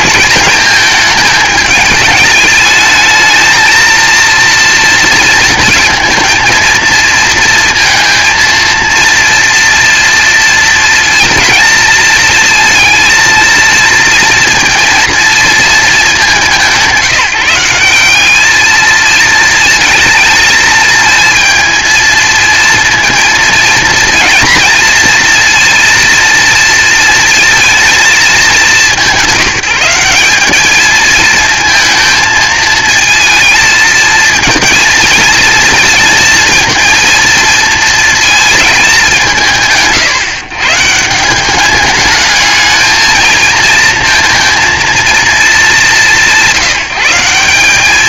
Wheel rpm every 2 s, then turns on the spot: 220, 220, 230, 230, 230, 230, 220, 230, 190, 220, 220, 230, 230, 230, 200, 220, 220, 230, 230, 210, 170, 220, 230, 180.
none